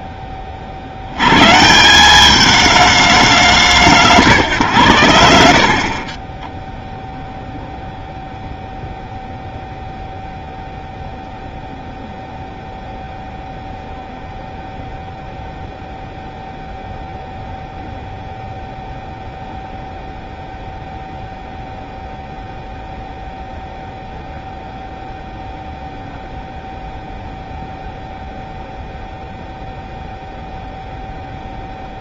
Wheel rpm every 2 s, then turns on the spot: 40, 210, 140, 10, 0, 0, 0, 0, 0, 0, 0, 0, 0, 0, 0, 0.
none